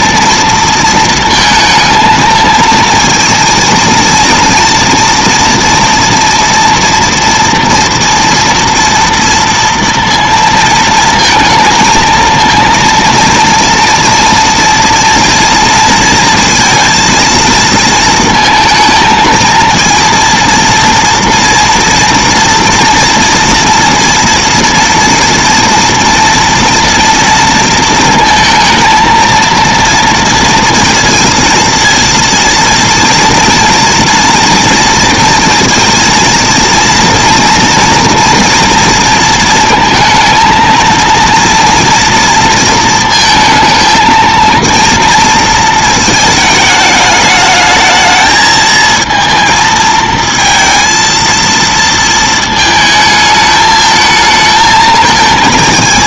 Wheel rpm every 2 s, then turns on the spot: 230, 230, 230, 230, 230, 230, 230, 230, 230, 220, 230, 230, 230, 230, 230, 230, 230, 230, 230, 230, 230, 230, 230, 210, 220, 230, 220, 220.
none